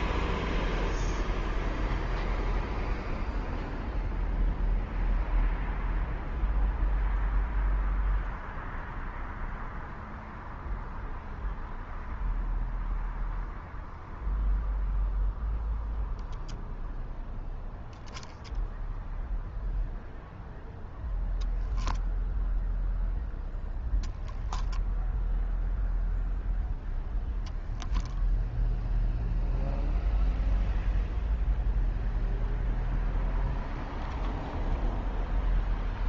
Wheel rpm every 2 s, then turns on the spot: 0, 0, 0, 0, 0, 0, 0, 0, 0, 0, 0, 0, 0, 10, 0, 0, 0, 0.
none